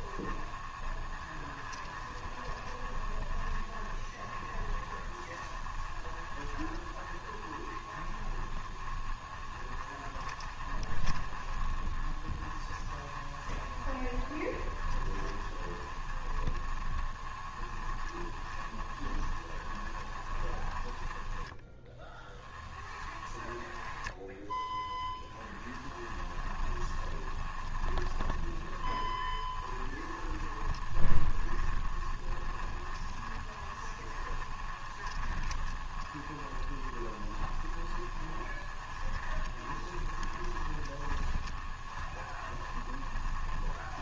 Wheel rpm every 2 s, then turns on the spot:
20, 20, 20, 20, 20, 20, 20, 20, 20, 20, 20, 10, 10, 20, 20, 20, 20, 20, 20, 20, 20, 20.
0-44